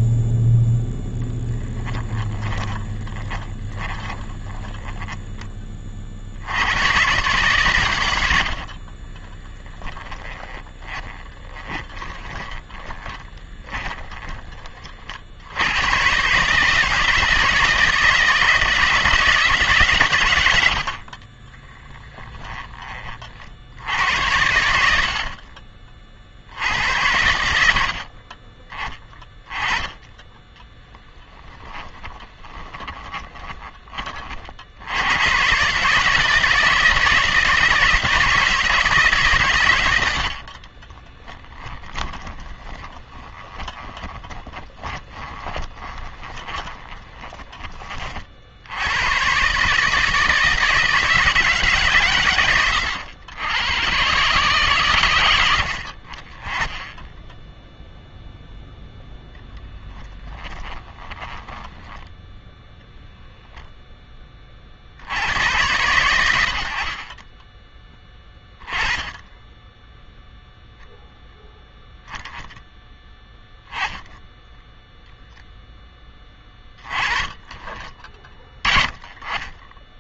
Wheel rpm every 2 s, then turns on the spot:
0, 20, 10, 100, 60, 30, 20, 40, 160, 170, 60, 20, 70, 90, 20, 10, 20, 70, 160, 160, 40, 20, 20, 20, 80, 160, 110, 130, 20, 0, 10, 0, 60, 40, 20, 0, 10, 0, 20, 30.
2-6 8-14 20-22 30-34 40-48 60-62 76-78